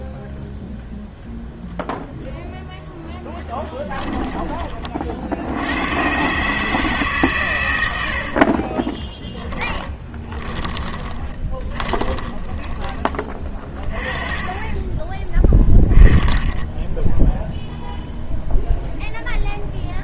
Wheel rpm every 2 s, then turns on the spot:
0, 0, 30, 150, 30, 20, 20, 20, 0, 0.
8-12